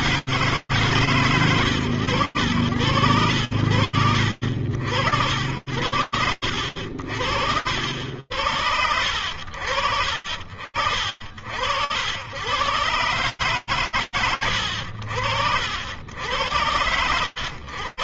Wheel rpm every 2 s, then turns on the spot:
120, 70, 80, 70, 70, 90, 130, 90, 70.
none